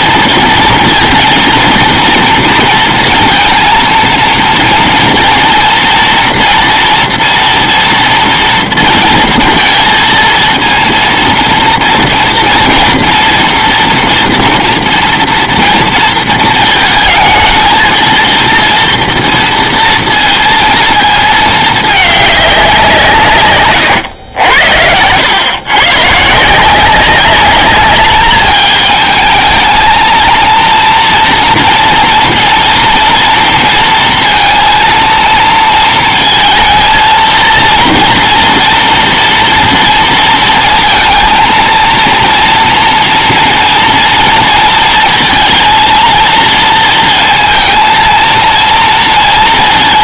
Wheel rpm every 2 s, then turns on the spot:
230, 230, 230, 230, 230, 230, 230, 230, 230, 230, 230, 200, 90, 150, 210, 230, 240, 230, 220, 230, 230, 230, 230, 230, 230.
none